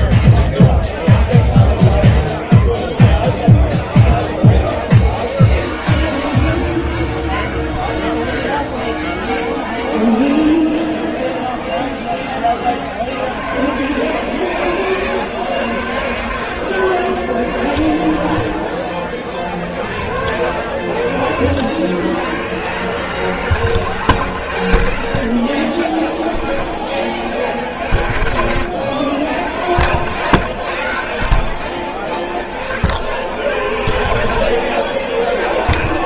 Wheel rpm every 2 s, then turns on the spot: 0, 0, 0, 0, 0, 0, 20, 70, 60, 30, 70, 120, 80, 20, 90, 100, 60, 60.
18-20